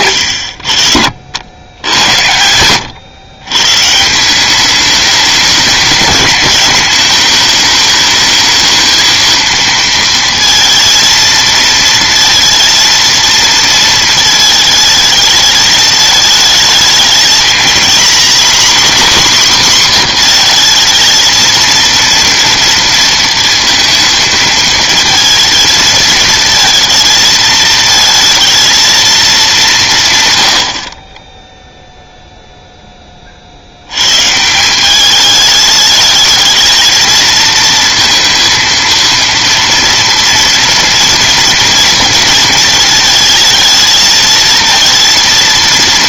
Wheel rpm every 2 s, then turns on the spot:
60, 90, 200, 210, 220, 230, 230, 220, 220, 250, 230, 230, 220, 230, 220, 80, 0, 180, 220, 230, 230, 220, 230.
2-4